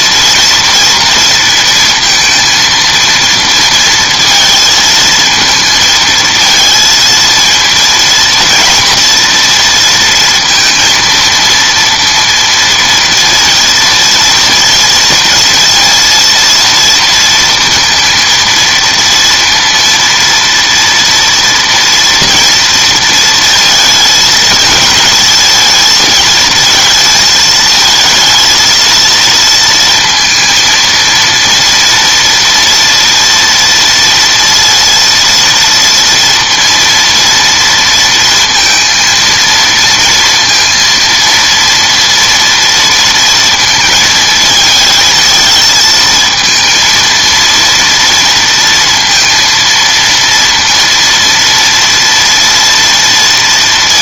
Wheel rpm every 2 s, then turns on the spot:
230, 230, 220, 230, 230, 230, 230, 230, 230, 230, 230, 230, 220, 220, 230, 230, 230, 230, 230, 230, 230, 230, 220, 230, 230, 230, 230.
none